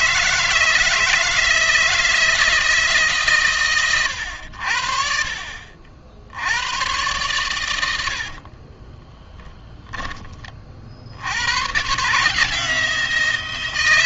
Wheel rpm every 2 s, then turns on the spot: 160, 150, 60, 120, 30, 60, 160.
8-10